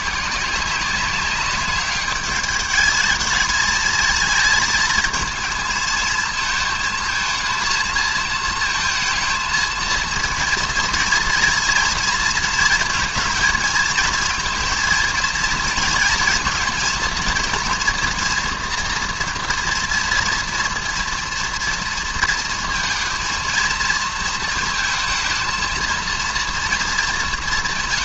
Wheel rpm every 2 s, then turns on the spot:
180, 210, 220, 220, 220, 230, 230, 230, 230, 230, 230, 230, 230, 230.
none